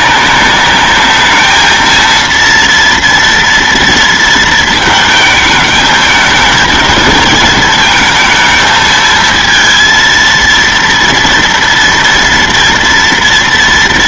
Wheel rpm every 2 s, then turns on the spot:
210, 230, 220, 220, 220, 230, 230.
none